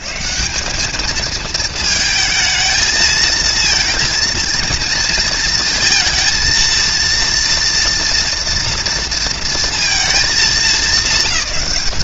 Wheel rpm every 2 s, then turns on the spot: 190, 220, 230, 230, 230, 210.
none